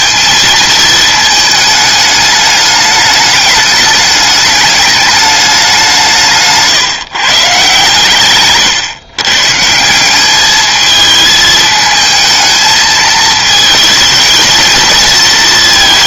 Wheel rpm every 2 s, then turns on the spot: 220, 210, 210, 160, 130, 210, 220, 220.
none